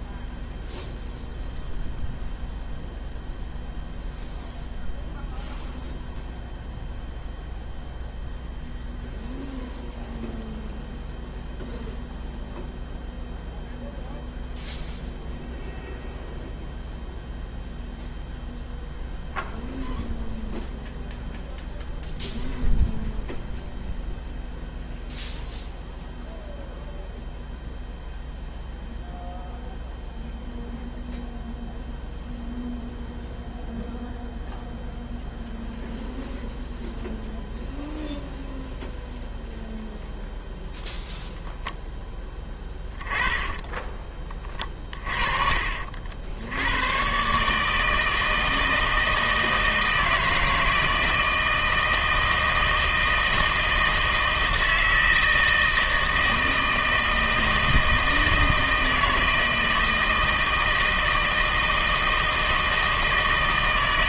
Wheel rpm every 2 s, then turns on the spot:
0, 0, 0, 0, 0, 0, 0, 0, 0, 0, 0, 0, 0, 0, 0, 0, 0, 0, 0, 0, 0, 10, 40, 100, 160, 160, 160, 160, 160, 160, 160, 160.
42-46